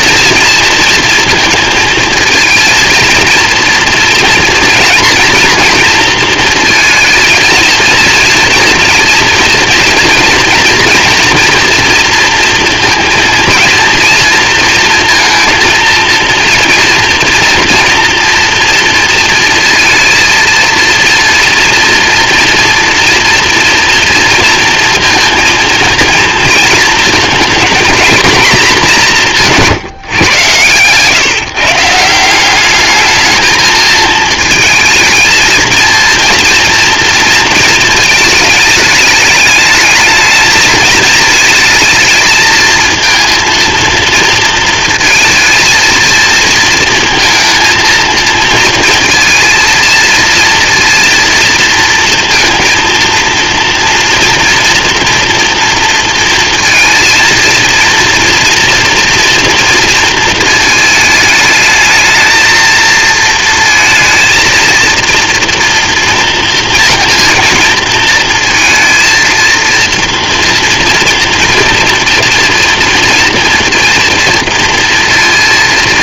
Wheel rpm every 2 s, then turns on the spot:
230, 230, 240, 220, 230, 230, 230, 230, 240, 230, 230, 240, 220, 230, 180, 140, 220, 230, 230, 210, 220, 220, 230, 230, 230, 230, 230, 230, 230, 230, 220, 230, 230, 230, 230, 230, 230, 230.
none